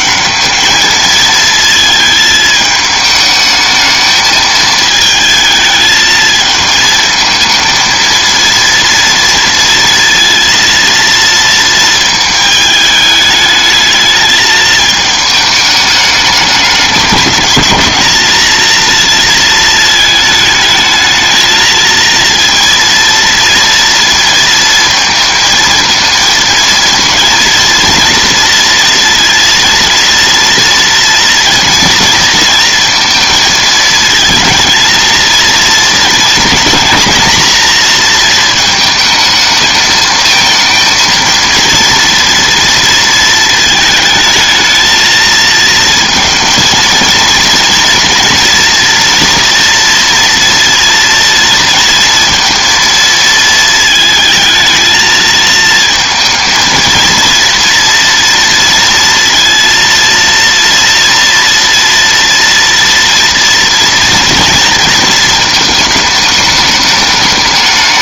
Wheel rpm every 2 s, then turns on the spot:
220, 220, 220, 220, 230, 230, 210, 220, 200, 230, 220, 230, 230, 230, 230, 230, 230, 230, 230, 220, 230, 230, 220, 230, 230, 230, 230, 220, 230, 230, 230, 230, 230, 210.
none